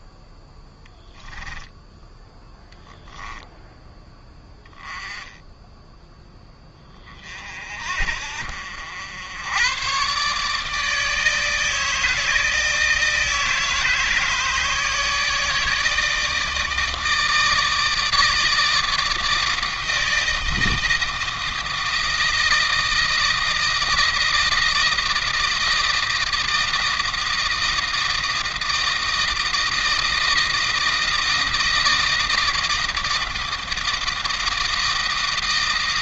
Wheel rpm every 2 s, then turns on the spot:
10, 0, 10, 20, 80, 150, 160, 160, 160, 160, 160, 160, 160, 160, 160, 160, 160, 160.
none